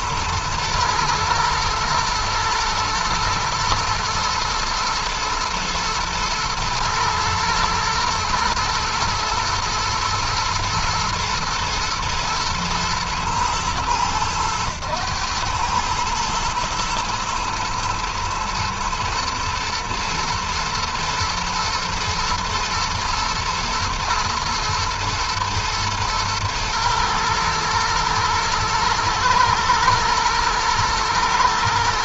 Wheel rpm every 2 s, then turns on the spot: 120, 120, 120, 120, 110, 120, 110, 110, 120, 120, 120, 110, 110, 110, 120, 110.
none